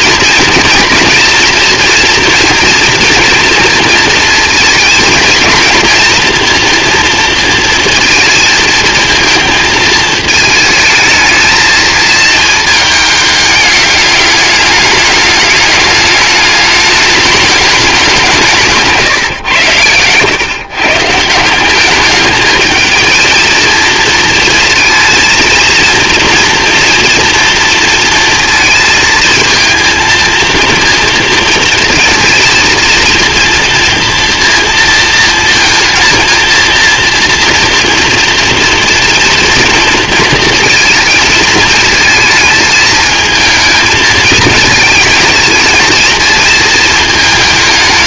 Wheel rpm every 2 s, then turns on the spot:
240, 230, 230, 230, 220, 220, 220, 210, 210, 160, 140, 220, 220, 240, 230, 220, 230, 230, 230, 230, 230, 220, 220, 220.
none